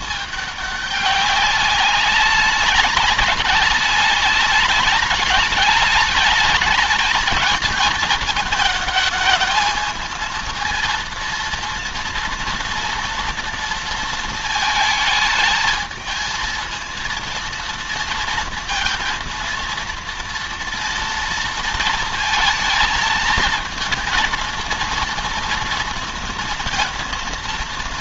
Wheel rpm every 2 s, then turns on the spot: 210, 200, 210, 210, 220, 230, 240, 220, 220, 230, 230, 220, 230, 230.
none